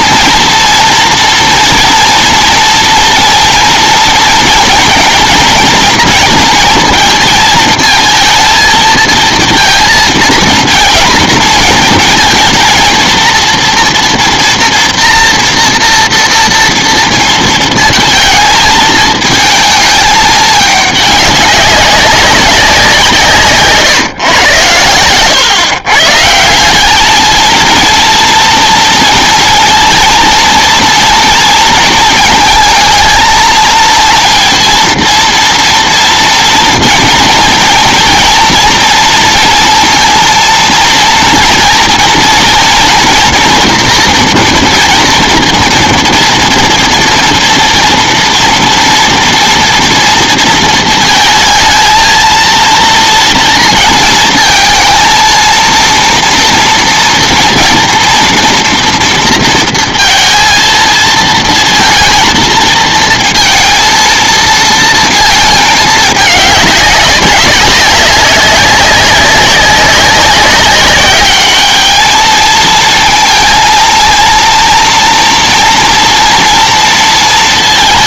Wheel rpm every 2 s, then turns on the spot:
230, 240, 230, 230, 230, 230, 230, 230, 230, 220, 210, 190, 110, 180, 230, 230, 220, 230, 230, 230, 230, 230, 230, 230, 230, 230, 230, 230, 240, 240, 230, 230, 230, 200, 190, 200, 220, 230, 230.
none